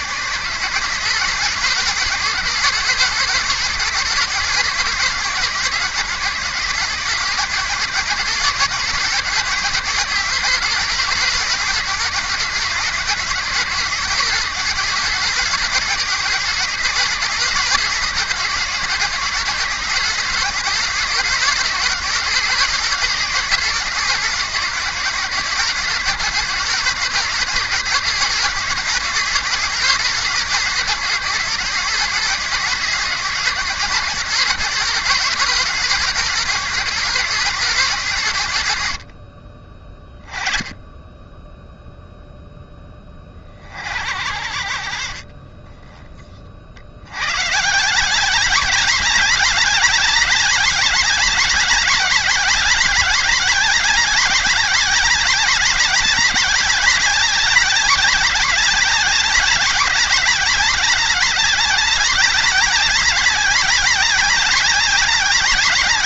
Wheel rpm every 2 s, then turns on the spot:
130, 150, 140, 130, 140, 140, 130, 140, 140, 130, 140, 140, 130, 140, 140, 130, 130, 140, 140, 70, 10, 10, 60, 60, 190, 200, 190, 190, 200, 190, 190, 190, 190.
none